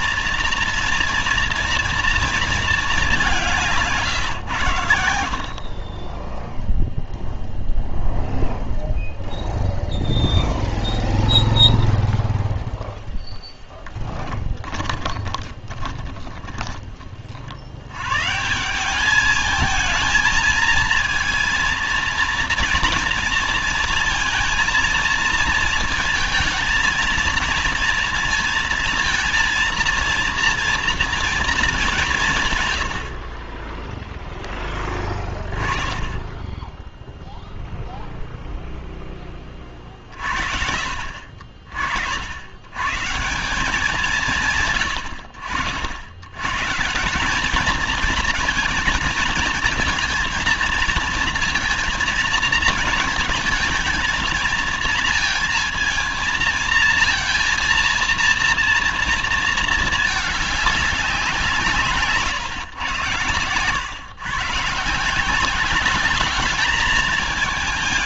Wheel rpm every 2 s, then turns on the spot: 230, 230, 120, 10, 0, 0, 0, 10, 40, 150, 220, 230, 230, 220, 230, 230, 140, 10, 10, 0, 60, 80, 170, 130, 220, 230, 230, 220, 230, 230, 210, 140, 140, 210.
14-18